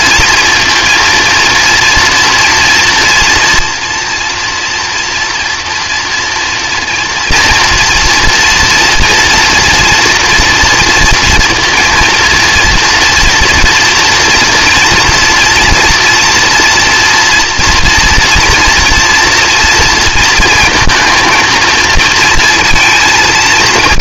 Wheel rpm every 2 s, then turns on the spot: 230, 230, 240, 230, 230, 230, 230, 230, 230, 230, 230, 230.
none